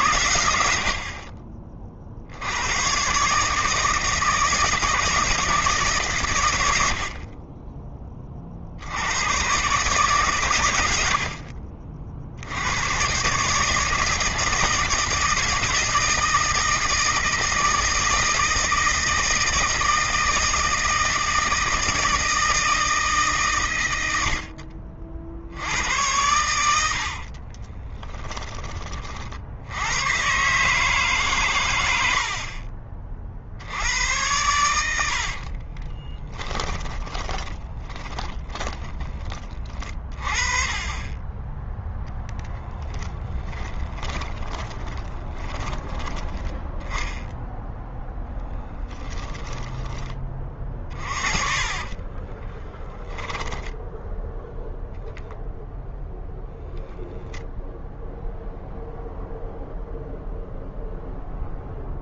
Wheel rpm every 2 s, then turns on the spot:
70, 110, 160, 70, 80, 100, 110, 160, 160, 160, 160, 160, 60, 80, 30, 140, 40, 70, 10, 20, 20, 10, 30, 10, 10, 30, 10, 0, 10, 0, 0.
26-28 34-38 40-46 48-54